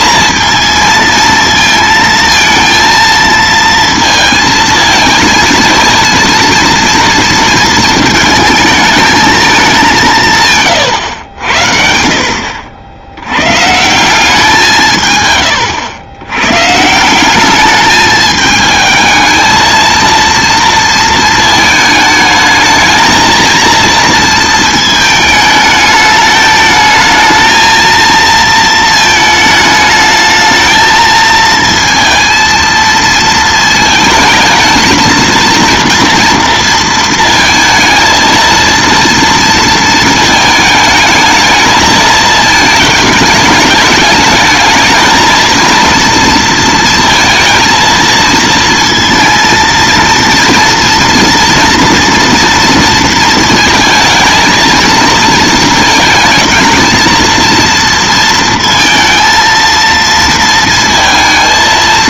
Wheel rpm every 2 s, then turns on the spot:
230, 230, 230, 230, 220, 110, 70, 150, 150, 220, 230, 220, 220, 220, 230, 220, 230, 220, 230, 230, 220, 220, 220, 230, 230, 230, 230, 220, 220, 230, 230.
none